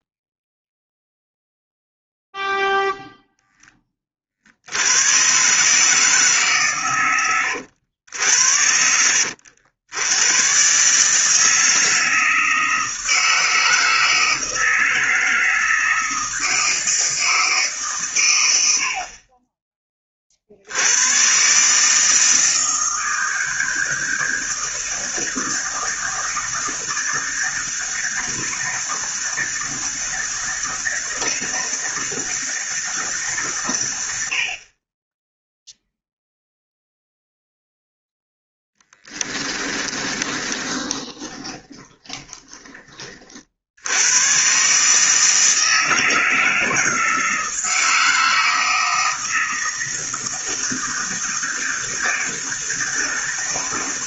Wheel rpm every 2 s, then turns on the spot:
0, 0, 80, 130, 80, 130, 160, 160, 160, 70, 90, 160, 160, 160, 160, 160, 160, 40, 0, 10, 20, 20, 130, 160, 160, 160, 160.
38-42